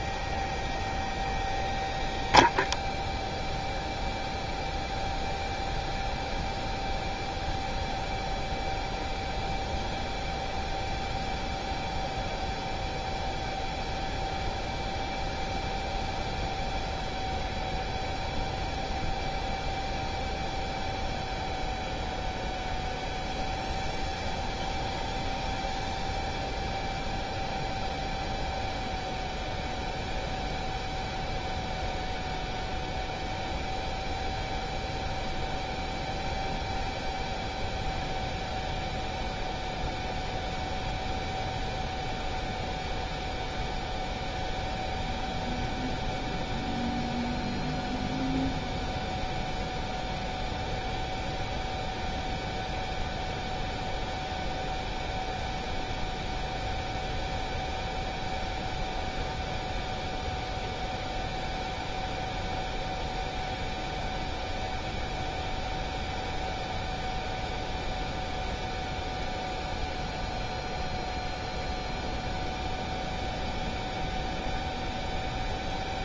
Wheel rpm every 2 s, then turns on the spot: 0, 0, 0, 0, 0, 0, 0, 0, 0, 0, 0, 0, 0, 0, 0, 0, 0, 0, 0, 0, 0, 0, 0, 0, 0, 0, 0, 0, 0, 0, 0, 0, 0, 0, 0, 0, 0, 0.
none